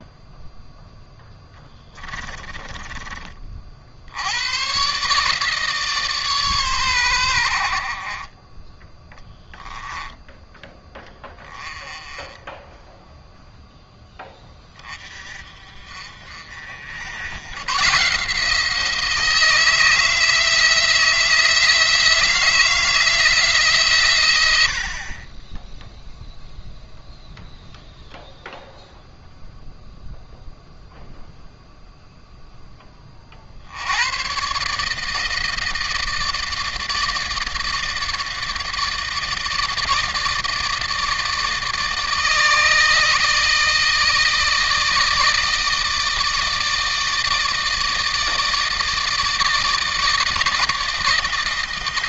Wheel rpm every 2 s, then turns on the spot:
0, 20, 120, 120, 20, 10, 10, 30, 70, 160, 160, 170, 90, 0, 0, 0, 10, 140, 160, 160, 160, 160, 160, 160, 160, 160.
2-4